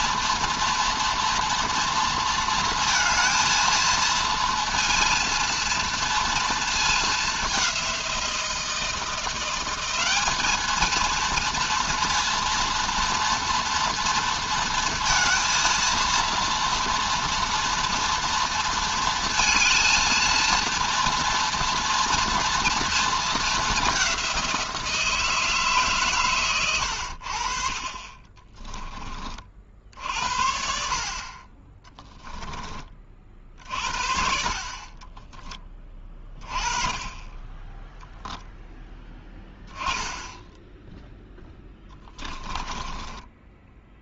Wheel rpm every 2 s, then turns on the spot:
230, 230, 230, 220, 170, 220, 230, 230, 230, 230, 230, 230, 170, 90, 20, 50, 30, 30, 20, 10, 0, 10.
34-36 42-44